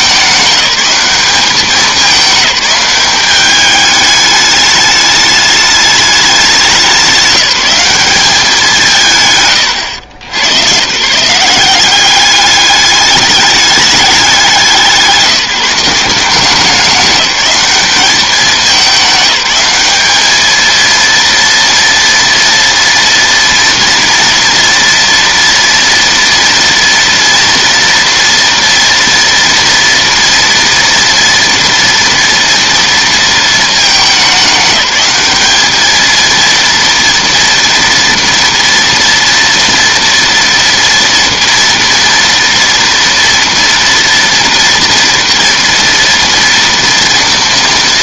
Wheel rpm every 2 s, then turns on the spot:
190, 200, 210, 190, 170, 150, 210, 180, 190, 200, 230, 230, 230, 230, 230, 230, 230, 200, 230, 230, 230, 240, 230, 230.
none